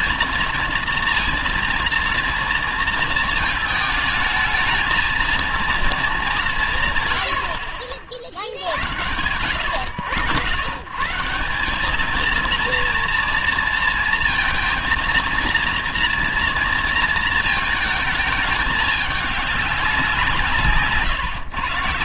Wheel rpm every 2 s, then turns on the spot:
230, 230, 220, 180, 60, 130, 230, 230, 230, 220, 150.
none